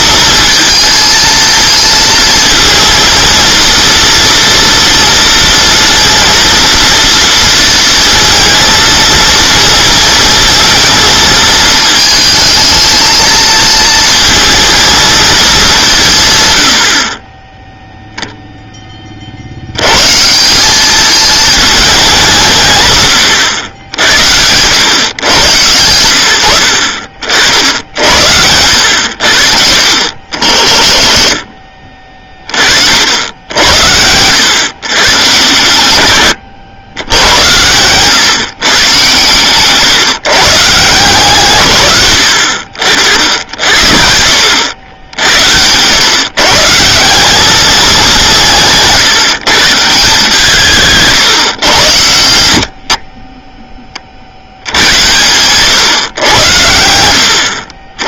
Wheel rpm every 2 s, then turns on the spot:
220, 230, 230, 230, 230, 220, 220, 230, 90, 10, 190, 160, 100, 70, 90, 50, 40, 120, 100, 130, 140, 60, 90, 150, 170, 150, 70, 80, 100.
26-28